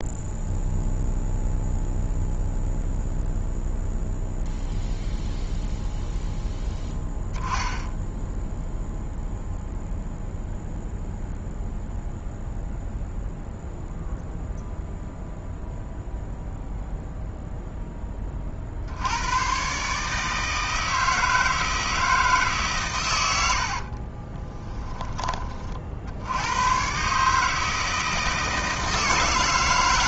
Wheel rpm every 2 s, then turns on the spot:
0, 0, 0, 0, 0, 0, 0, 0, 0, 80, 160, 130, 20, 130, 160.
none